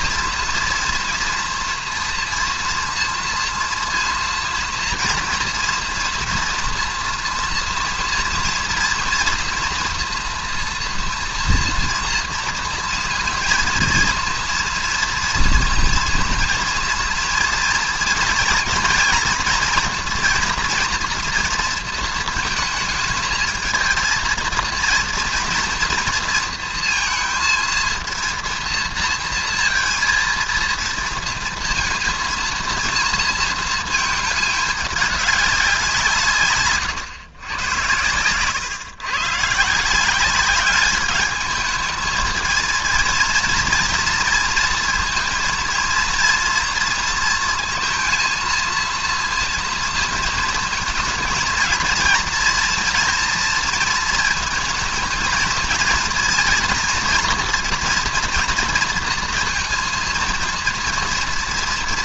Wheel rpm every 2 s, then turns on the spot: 230, 230, 230, 230, 230, 230, 230, 230, 230, 230, 240, 220, 230, 230, 230, 230, 230, 210, 140, 130, 200, 220, 230, 230, 230, 220, 230, 220, 240, 230, 230.
36-38